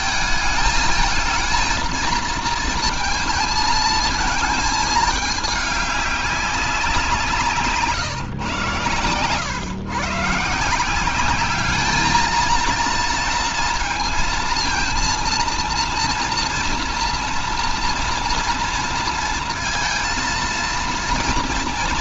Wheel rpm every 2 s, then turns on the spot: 220, 220, 220, 190, 120, 170, 230, 230, 230, 230, 230.
none